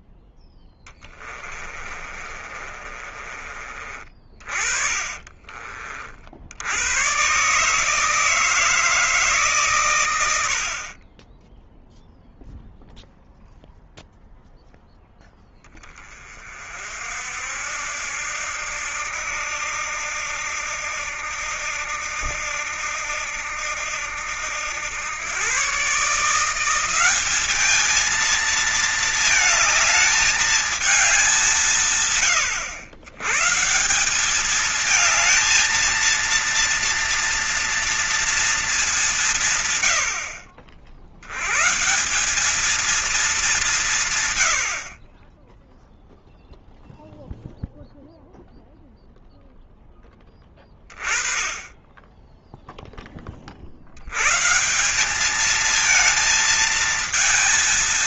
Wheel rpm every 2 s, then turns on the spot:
10, 30, 30, 80, 160, 60, 0, 0, 40, 80, 80, 80, 90, 180, 220, 210, 100, 210, 230, 210, 60, 210, 80, 0, 0, 10, 10, 150, 220.
0-6